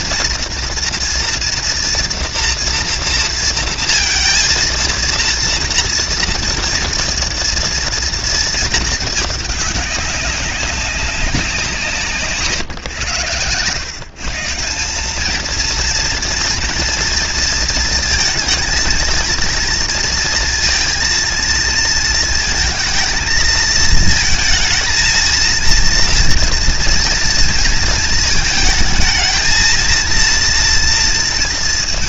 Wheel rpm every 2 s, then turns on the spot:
230, 230, 230, 230, 220, 190, 130, 190, 230, 230, 230, 220, 220, 240, 220, 230.
none